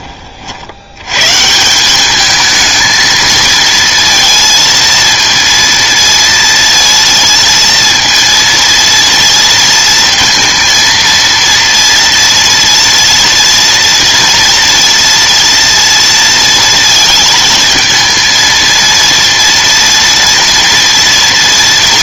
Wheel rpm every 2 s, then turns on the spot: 60, 220, 230, 230, 230, 230, 230, 230, 230, 230, 230.
none